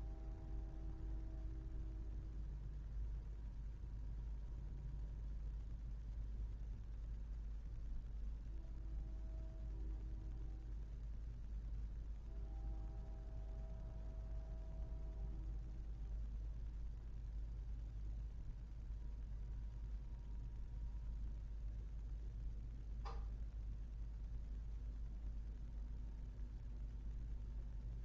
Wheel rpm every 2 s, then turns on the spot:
0, 0, 0, 0, 0, 0, 0, 0, 0, 0, 0, 0, 0, 0.
none